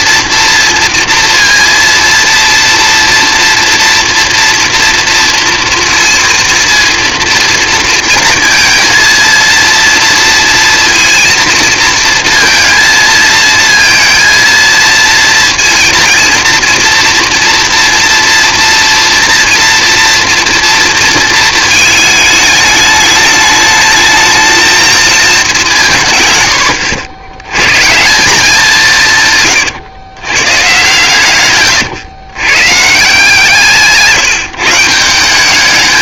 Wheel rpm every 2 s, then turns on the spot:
230, 240, 230, 230, 230, 230, 230, 230, 230, 230, 230, 210, 220, 90, 170, 130, 150, 180.
none